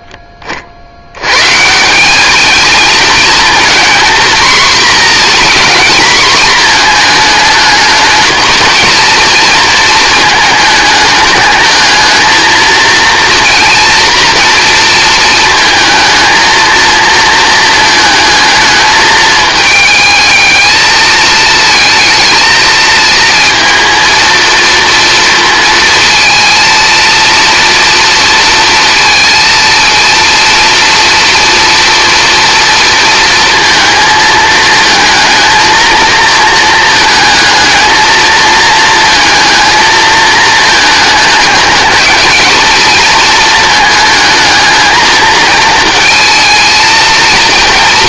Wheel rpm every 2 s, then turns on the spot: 60, 220, 240, 230, 230, 220, 230, 230, 230, 220, 220, 220, 230, 230, 230, 230, 230, 220, 220, 220, 220, 220, 220, 230.
none